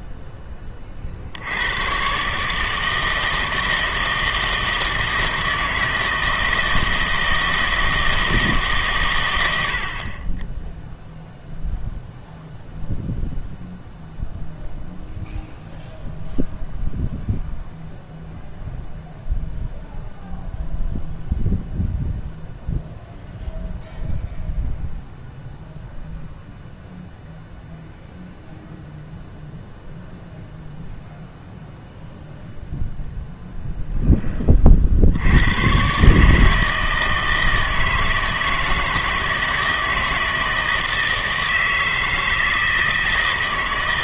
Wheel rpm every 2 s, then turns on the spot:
20, 160, 160, 160, 150, 10, 0, 0, 0, 0, 0, 0, 0, 0, 0, 0, 0, 40, 160, 160, 160, 160.
none